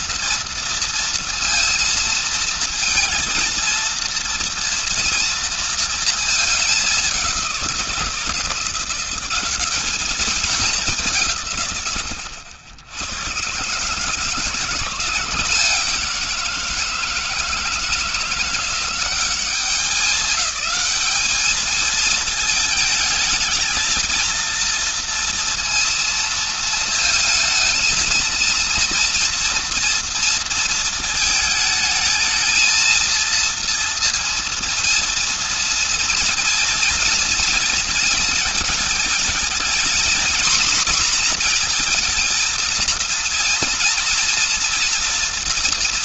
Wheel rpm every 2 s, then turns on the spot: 230, 230, 230, 210, 170, 210, 100, 160, 170, 170, 190, 220, 230, 230, 230, 220, 220, 230, 230, 220, 240, 230, 240.
none